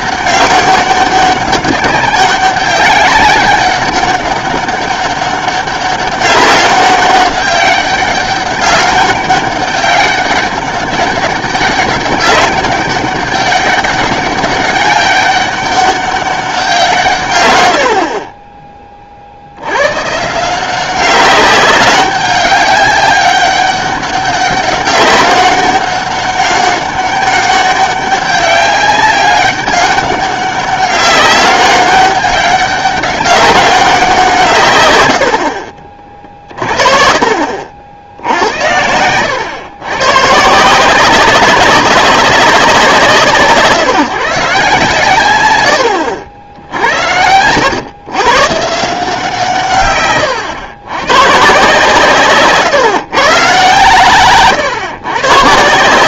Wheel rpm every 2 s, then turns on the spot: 200, 190, 200, 200, 190, 190, 200, 200, 180, 20, 170, 200, 200, 200, 200, 200, 200, 130, 40, 80, 160, 180, 140, 70, 140, 110, 140, 130.
36-40